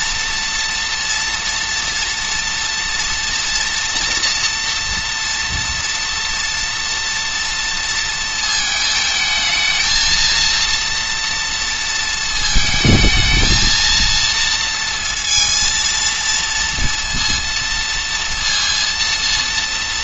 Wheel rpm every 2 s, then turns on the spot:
230, 230, 230, 230, 220, 230, 220, 230, 230, 230.
none